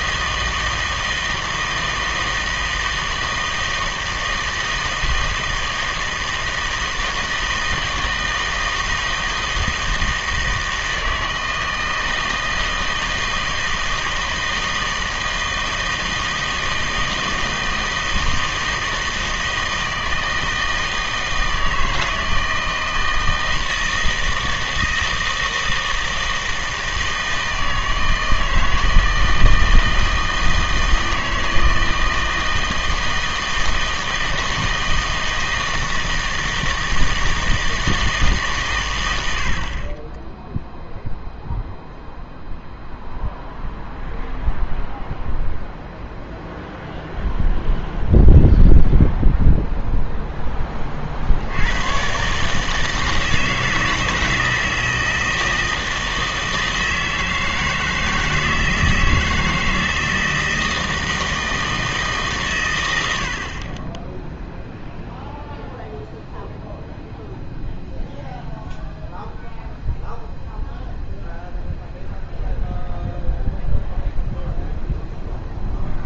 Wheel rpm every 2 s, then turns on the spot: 160, 160, 160, 160, 160, 160, 160, 160, 160, 160, 160, 160, 160, 160, 160, 160, 160, 160, 160, 130, 0, 0, 0, 0, 0, 20, 160, 160, 160, 160, 160, 120, 0, 0, 0, 0, 0, 0.
none